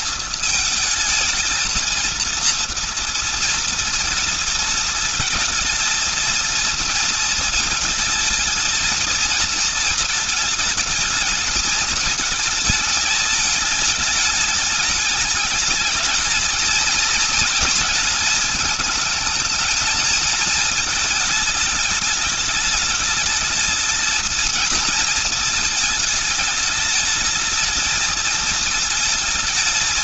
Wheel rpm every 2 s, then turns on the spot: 220, 230, 230, 230, 220, 220, 210, 210, 220, 220, 220, 210, 230, 220, 220.
none